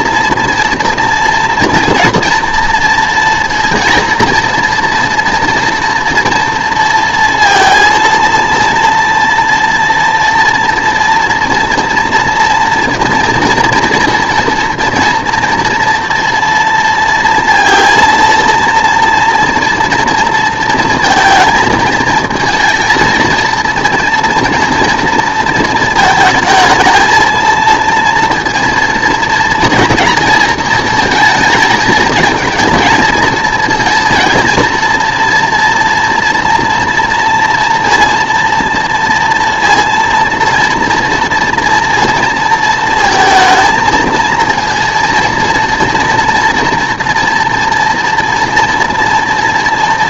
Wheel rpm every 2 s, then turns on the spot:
230, 230, 230, 230, 230, 240, 230, 230, 230, 230, 230, 220, 230, 220, 230, 230, 230, 230, 240, 230, 230, 230, 230, 230, 230.
none